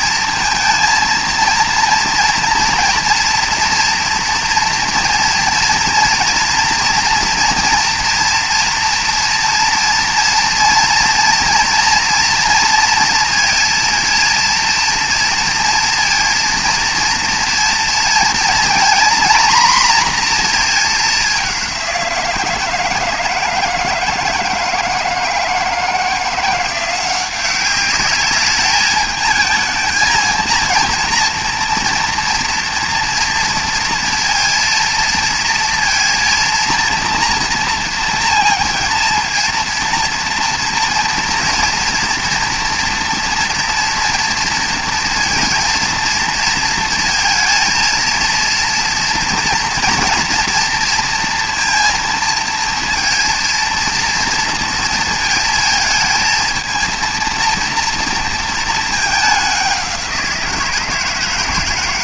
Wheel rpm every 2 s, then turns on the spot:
230, 230, 230, 240, 230, 230, 230, 230, 230, 240, 210, 160, 160, 180, 220, 230, 230, 230, 230, 230, 230, 230, 230, 230, 230, 230, 230, 230, 230, 210, 160.
none